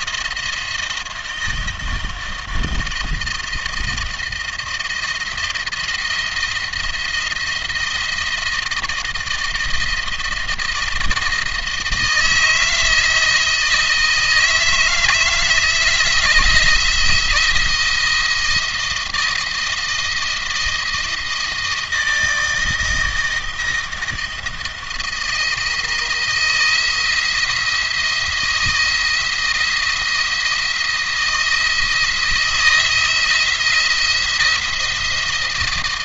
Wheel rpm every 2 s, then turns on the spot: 170, 160, 170, 170, 170, 160, 160, 160, 170, 160, 160, 160, 160, 160, 170, 170, 170, 170.
none